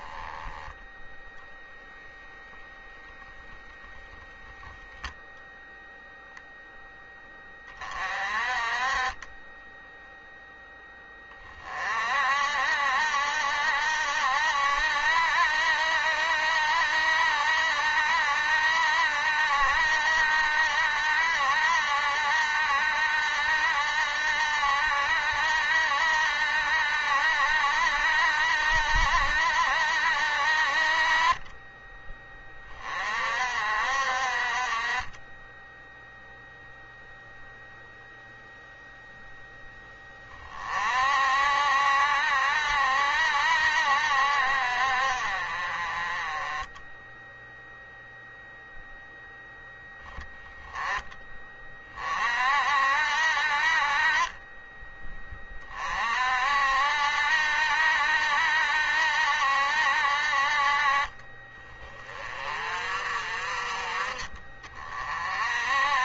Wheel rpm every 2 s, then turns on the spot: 10, 0, 0, 0, 30, 10, 50, 70, 70, 60, 70, 70, 70, 70, 70, 60, 20, 50, 0, 0, 20, 60, 60, 20, 0, 0, 50, 20, 50, 70, 50, 40, 30.
54-56